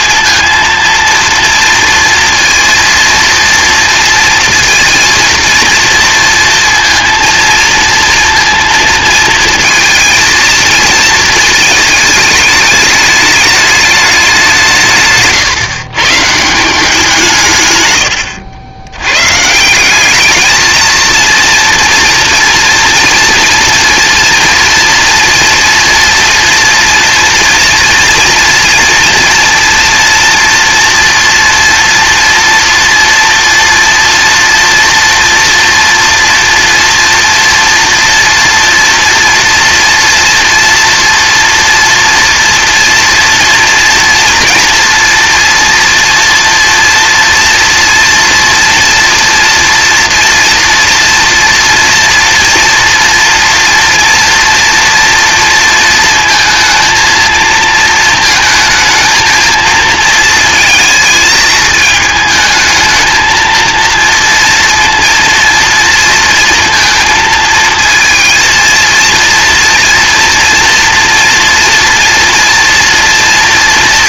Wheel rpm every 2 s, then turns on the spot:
230, 230, 230, 230, 230, 230, 220, 160, 170, 80, 220, 230, 230, 230, 230, 230, 230, 230, 230, 230, 230, 230, 230, 240, 230, 230, 230, 230, 220, 220, 220, 220, 230, 230, 230, 230, 230.
none